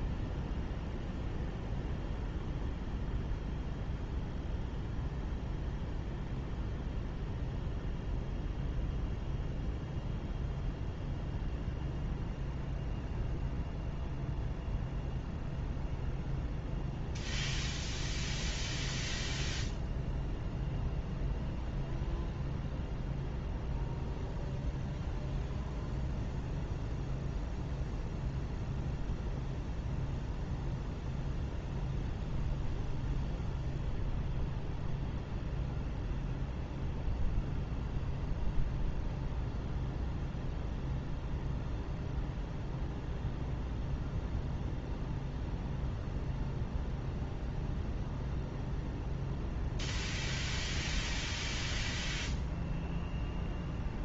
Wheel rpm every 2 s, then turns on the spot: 0, 0, 0, 0, 0, 0, 0, 0, 0, 0, 0, 0, 0, 0, 0, 0, 0, 0, 0, 0, 0, 0, 0, 0, 0, 0, 0.
none